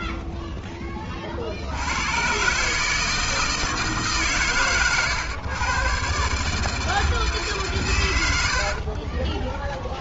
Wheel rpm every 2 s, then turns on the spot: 70, 160, 120, 150, 20.
none